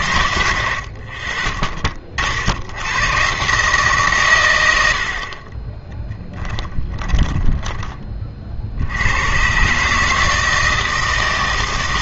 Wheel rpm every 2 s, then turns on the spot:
70, 90, 100, 20, 70, 160.
6-8